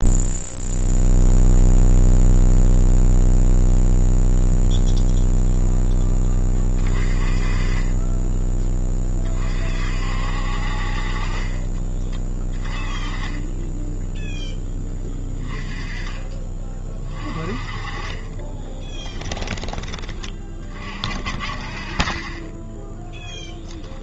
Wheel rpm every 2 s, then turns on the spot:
0, 0, 0, 30, 20, 50, 20, 10, 30, 10, 40, 10.
12-14 18-20